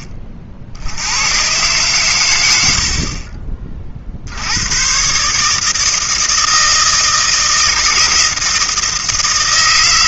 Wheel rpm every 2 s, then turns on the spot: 50, 110, 90, 160, 160.
none